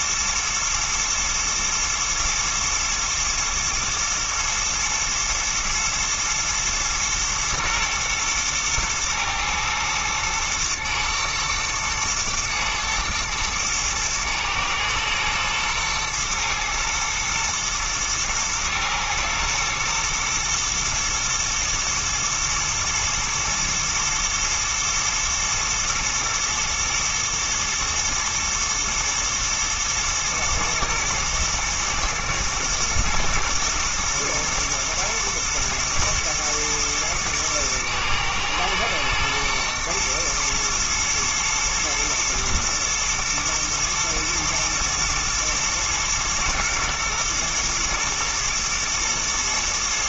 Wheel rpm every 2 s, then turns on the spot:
120, 110, 110, 110, 110, 110, 110, 110, 110, 110, 120, 120, 110, 120, 120, 120, 120, 120, 110, 110, 110, 110, 110, 110, 110.
none